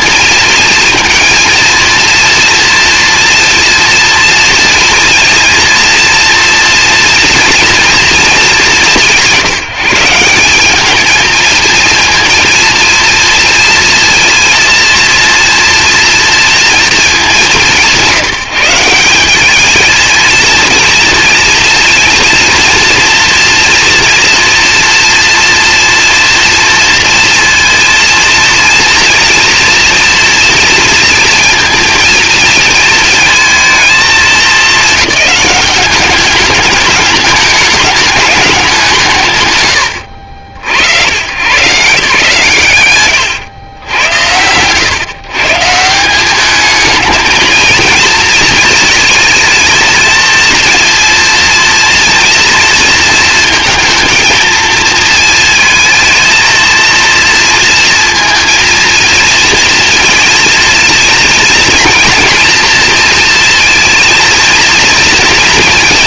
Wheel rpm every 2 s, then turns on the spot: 230, 230, 230, 230, 210, 190, 230, 230, 230, 170, 230, 230, 230, 230, 230, 230, 220, 210, 210, 190, 90, 130, 110, 210, 220, 230, 230, 230, 230, 230, 230, 230, 230.
none